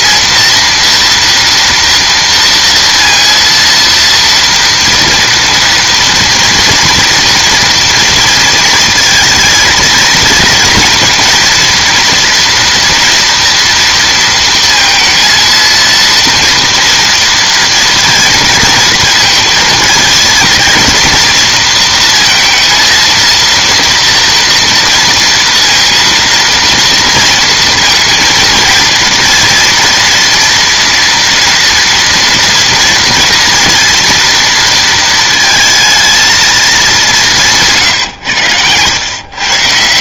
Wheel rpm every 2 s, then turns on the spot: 230, 230, 230, 230, 230, 230, 230, 230, 230, 230, 230, 230, 230, 230, 230, 230, 230, 230, 220, 100.
none